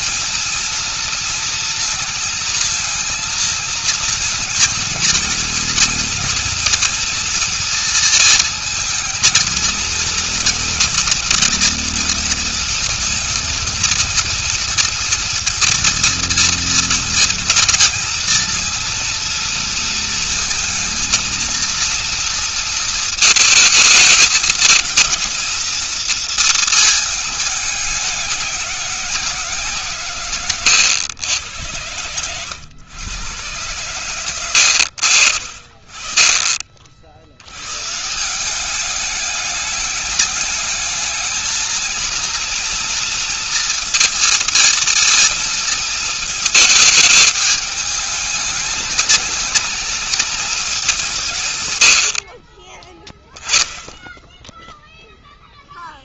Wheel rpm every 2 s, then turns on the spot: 230, 230, 230, 230, 220, 230, 230, 230, 230, 230, 230, 230, 230, 220, 190, 110, 110, 80, 60, 200, 210, 230, 230, 220, 210, 180, 10, 0.
none